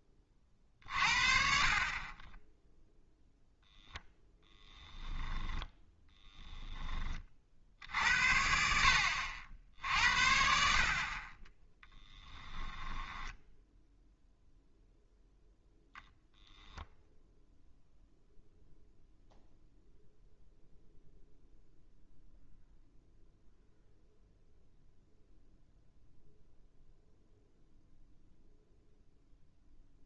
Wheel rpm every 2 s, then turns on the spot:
50, 0, 0, 20, 70, 50, 10, 0, 0, 0, 0, 0, 0, 0, 0.
8-10 12-14